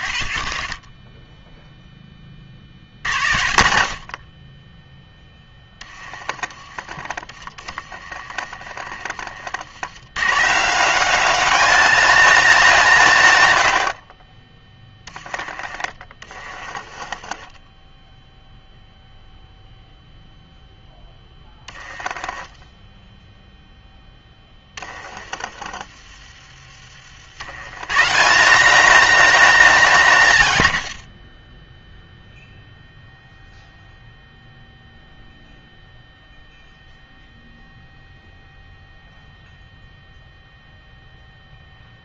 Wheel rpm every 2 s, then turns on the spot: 10, 60, 20, 30, 40, 160, 180, 20, 30, 0, 0, 10, 20, 40, 190, 110, 0, 0, 0, 0, 0.
6-10 14-18 22-26